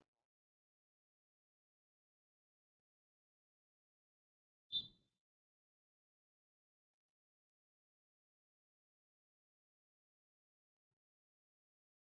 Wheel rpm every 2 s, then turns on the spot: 0, 0, 0, 0, 0, 0.
none